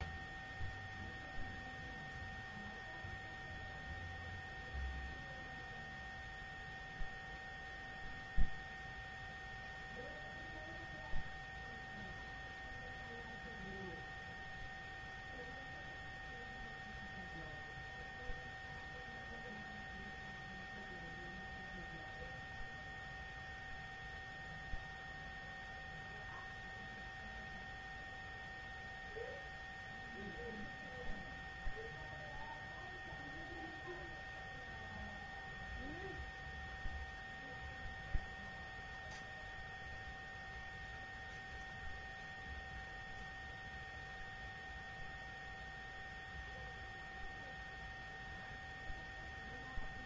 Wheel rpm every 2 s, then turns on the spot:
0, 0, 0, 0, 0, 0, 0, 0, 0, 0, 0, 0, 0, 0, 0, 0, 0, 0, 0, 0, 0, 0, 0, 0, 0.
none